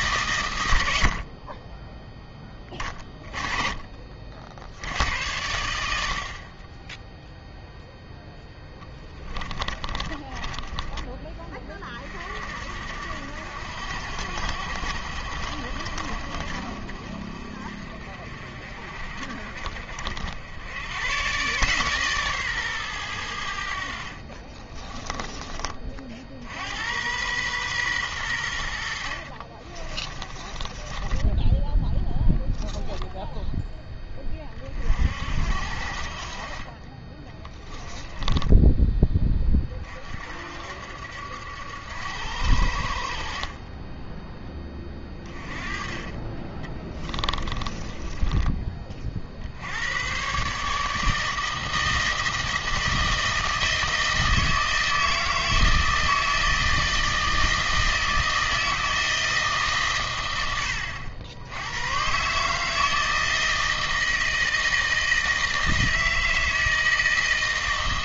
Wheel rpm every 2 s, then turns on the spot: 100, 30, 70, 20, 10, 10, 60, 60, 60, 50, 100, 120, 30, 80, 70, 20, 0, 40, 20, 10, 70, 60, 20, 20, 30, 150, 160, 160, 160, 160, 90, 160, 160, 160.
8-12 24-26 30-32 46-48